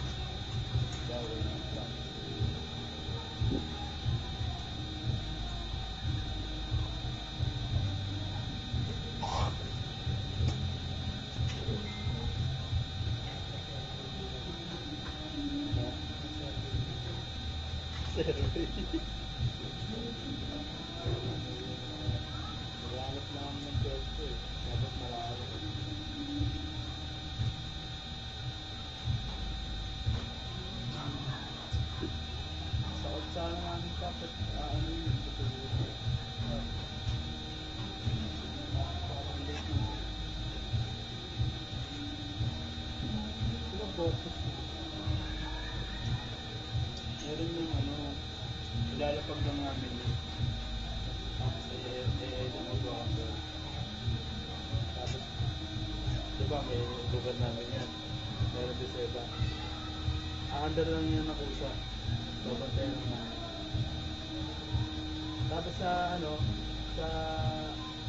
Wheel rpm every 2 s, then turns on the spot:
0, 0, 0, 0, 0, 0, 0, 0, 0, 0, 0, 0, 0, 0, 0, 0, 0, 0, 0, 0, 0, 0, 0, 0, 0, 0, 0, 0, 0, 0, 0, 0, 0, 0.
none